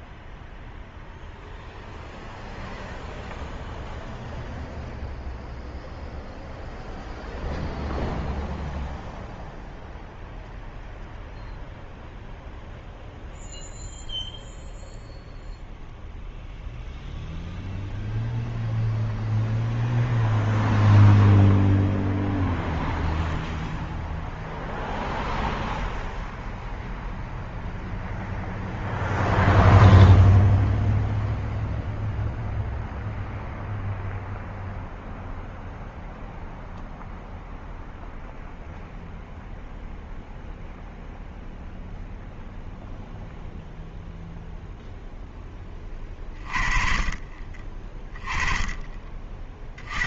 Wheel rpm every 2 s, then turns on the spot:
0, 0, 0, 0, 0, 0, 0, 0, 0, 0, 0, 0, 0, 0, 0, 0, 0, 0, 0, 0, 0, 0, 0, 30, 30.
none